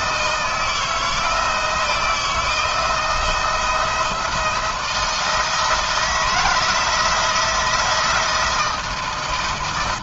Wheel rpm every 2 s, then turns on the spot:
160, 170, 170, 160, 160.
none